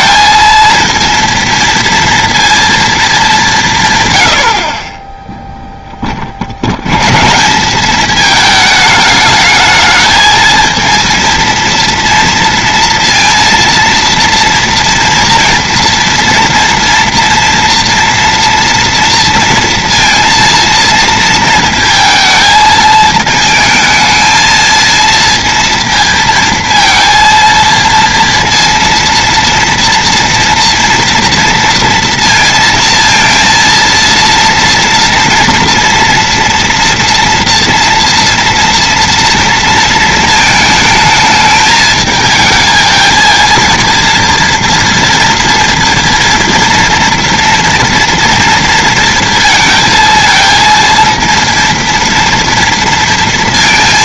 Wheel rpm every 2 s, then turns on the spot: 230, 230, 50, 80, 220, 220, 230, 230, 230, 230, 230, 220, 220, 230, 230, 240, 230, 230, 230, 230, 220, 220, 230, 230, 230, 230, 230.
none